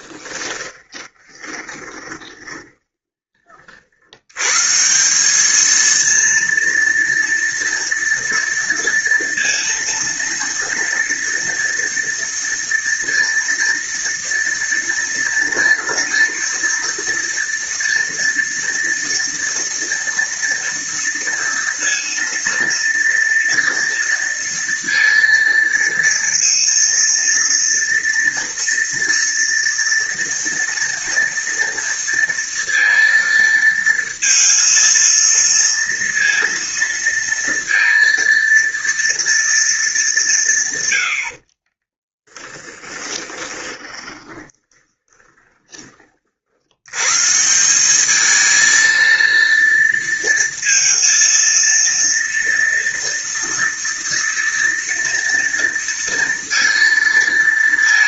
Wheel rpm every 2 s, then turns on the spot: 20, 20, 100, 230, 230, 230, 230, 230, 230, 230, 230, 230, 230, 230, 230, 230, 230, 230, 230, 230, 180, 10, 20, 50, 220, 230, 230, 230, 230.
0-4 42-46